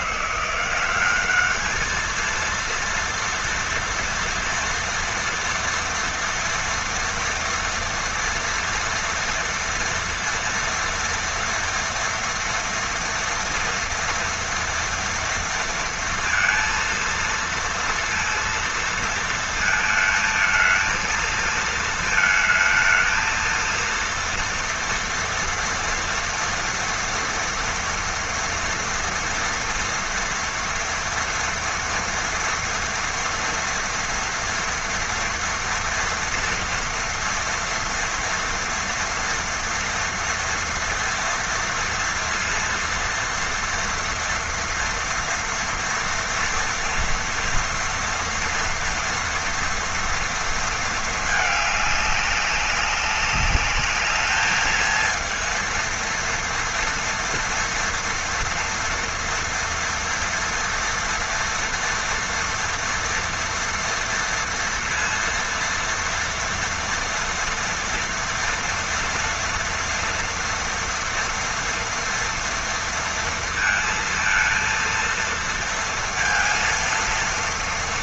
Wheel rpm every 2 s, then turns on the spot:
170, 230, 230, 230, 230, 230, 230, 230, 230, 230, 220, 220, 230, 230, 230, 230, 230, 240, 230, 230, 230, 230, 230, 230, 230, 230, 200, 220, 230, 230, 230, 230, 230, 230, 230, 230, 230, 230, 230.
none